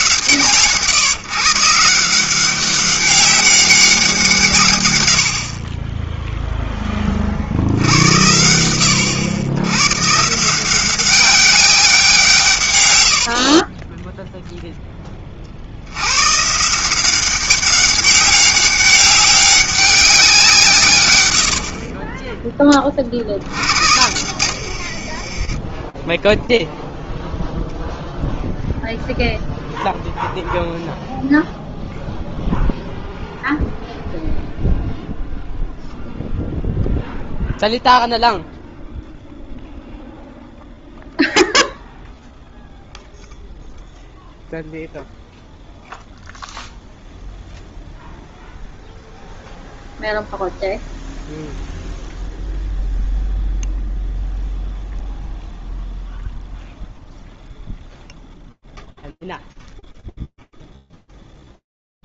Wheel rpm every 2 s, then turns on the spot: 150, 190, 120, 30, 110, 190, 100, 10, 170, 200, 130, 30, 60, 0, 0, 0, 0, 0, 0, 0, 0, 0, 0, 0, 0, 0, 0, 0, 0, 0, 0.
24-26